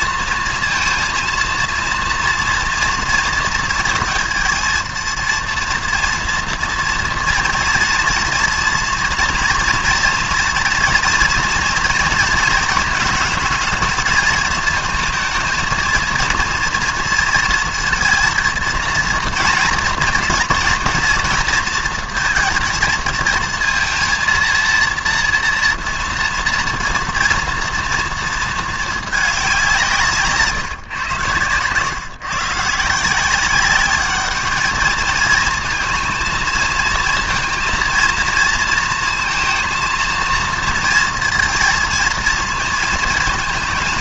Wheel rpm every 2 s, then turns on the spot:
230, 230, 230, 230, 230, 230, 220, 220, 230, 230, 230, 220, 230, 230, 220, 140, 160, 210, 230, 230, 230, 230.
30-32